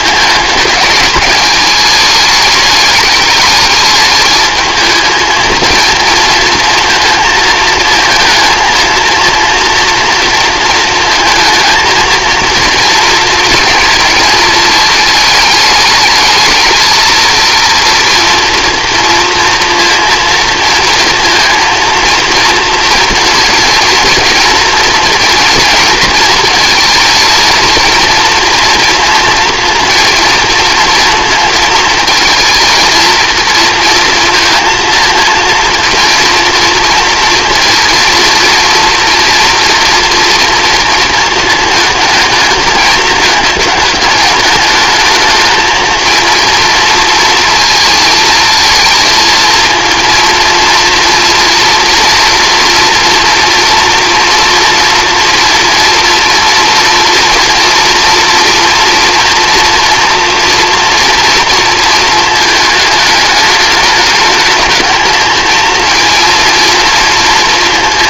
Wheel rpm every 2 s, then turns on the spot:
220, 210, 220, 230, 230, 220, 230, 220, 220, 230, 230, 230, 230, 230, 230, 230, 230, 230, 230, 230, 230, 220, 210, 230, 230, 230, 230, 230, 230, 230, 230, 220, 210, 230.
none